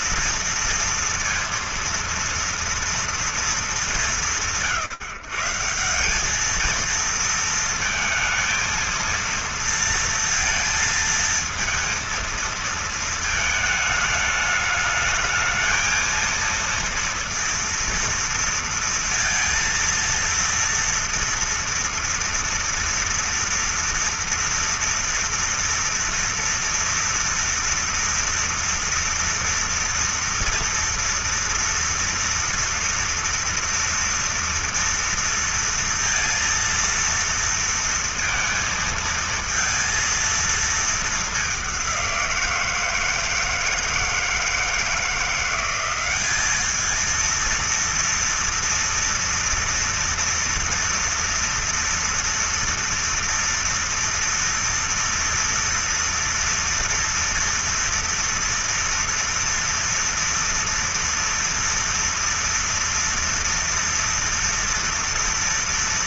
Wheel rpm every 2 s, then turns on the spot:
230, 230, 140, 230, 230, 230, 220, 220, 230, 230, 230, 230, 230, 240, 230, 230, 230, 230, 230, 230, 210, 160, 170, 220, 230, 230, 230, 230, 230, 230, 230, 230, 230.
none